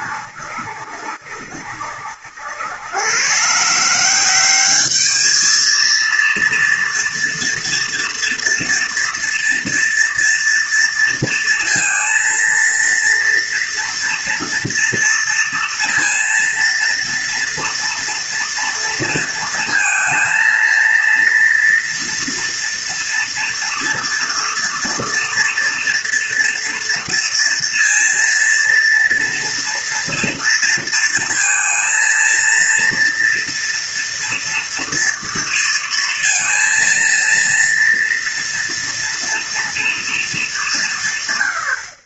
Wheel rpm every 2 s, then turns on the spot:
70, 90, 200, 230, 240, 230, 230, 230, 230, 230, 230, 230, 230, 230, 230, 230, 230, 230, 230, 230, 190.
none